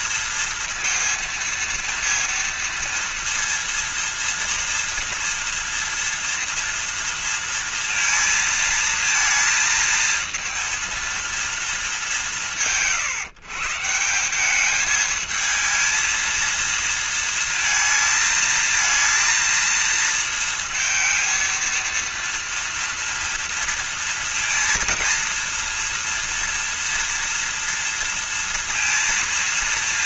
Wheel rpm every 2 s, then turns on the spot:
230, 230, 230, 230, 230, 230, 140, 190, 230, 230, 230, 230, 230, 230, 230.
none